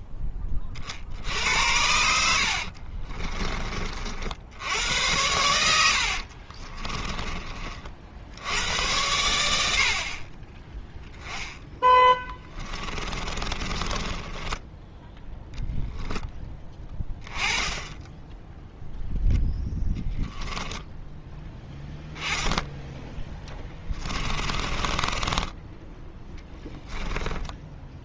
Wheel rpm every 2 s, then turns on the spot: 30, 40, 90, 20, 90, 10, 30, 10, 10, 0, 10, 10, 30, 10.
2-4 6-8 12-14 24-28